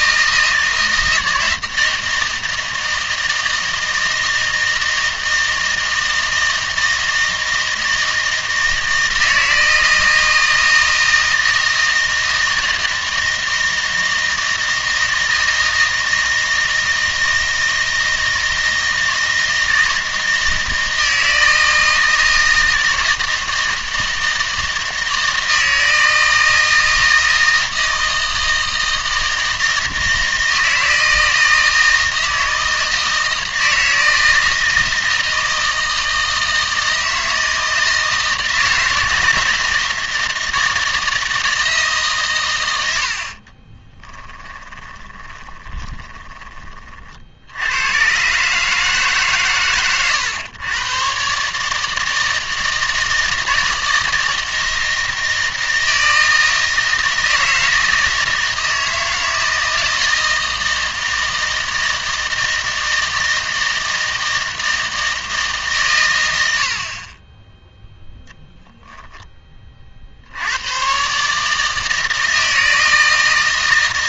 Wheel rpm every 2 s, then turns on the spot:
160, 160, 160, 160, 160, 160, 160, 160, 160, 160, 160, 160, 160, 160, 160, 160, 160, 160, 160, 160, 160, 100, 10, 30, 150, 110, 160, 160, 160, 160, 160, 160, 160, 60, 10, 110, 160.
44-46